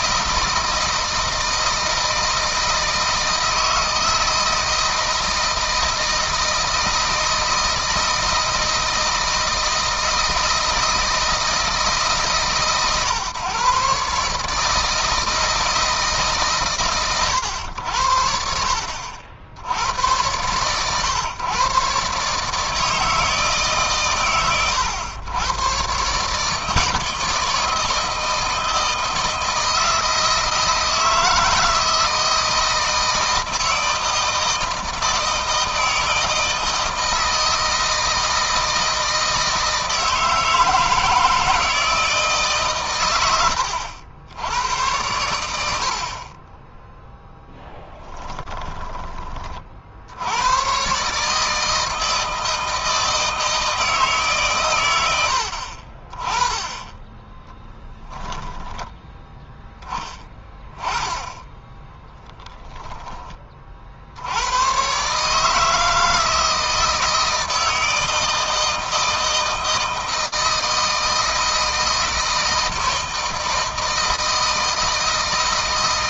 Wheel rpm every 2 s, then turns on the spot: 160, 160, 160, 160, 160, 160, 140, 160, 130, 60, 120, 160, 100, 160, 160, 160, 160, 160, 160, 160, 160, 120, 80, 10, 20, 130, 160, 100, 20, 10, 10, 10, 120, 160, 160, 160, 160, 160.
46-48